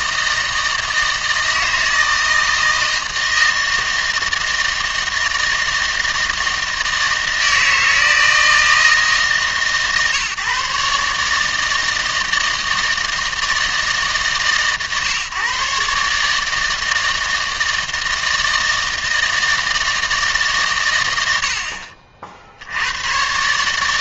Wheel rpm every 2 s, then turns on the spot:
160, 160, 160, 160, 160, 140, 160, 140, 160, 160, 130, 80.
none